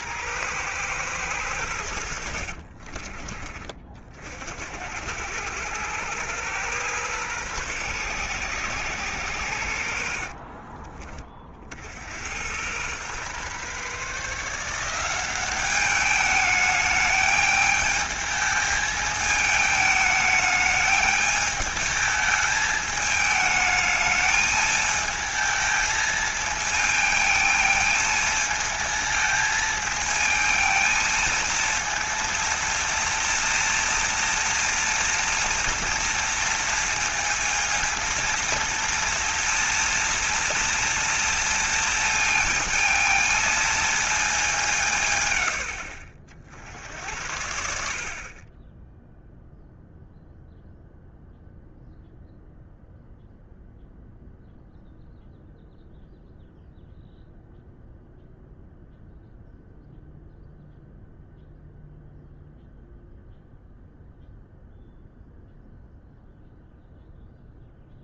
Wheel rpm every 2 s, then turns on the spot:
120, 40, 70, 120, 120, 40, 110, 170, 210, 220, 220, 220, 220, 220, 220, 230, 230, 240, 230, 230, 230, 230, 180, 70, 10, 0, 0, 0, 0, 0, 0, 0, 0, 0.
2-4